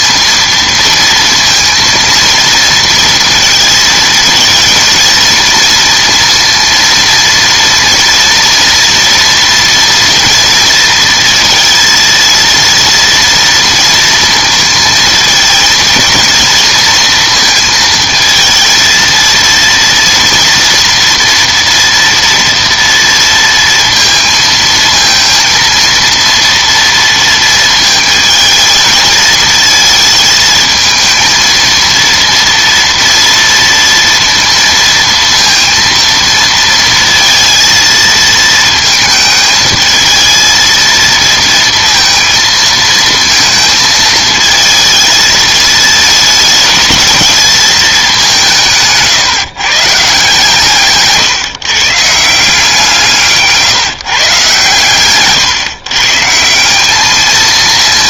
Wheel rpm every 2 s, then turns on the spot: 230, 230, 230, 230, 230, 230, 230, 230, 230, 230, 240, 230, 230, 230, 220, 220, 230, 230, 230, 220, 230, 230, 220, 220, 160, 150, 170, 140, 200.
none